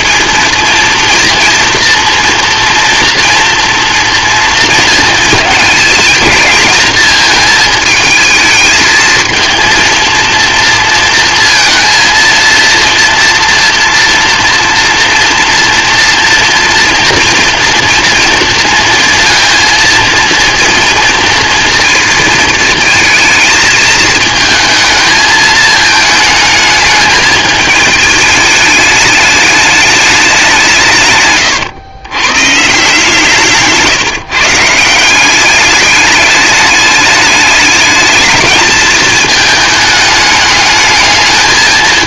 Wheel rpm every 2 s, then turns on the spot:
230, 230, 230, 220, 220, 230, 230, 230, 230, 230, 230, 230, 220, 220, 210, 160, 150, 160, 210, 220, 210.
none